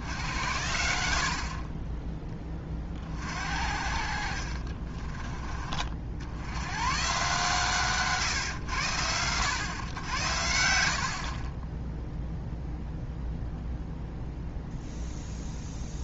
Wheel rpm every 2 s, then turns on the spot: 80, 30, 40, 100, 110, 70, 0, 0.
4-6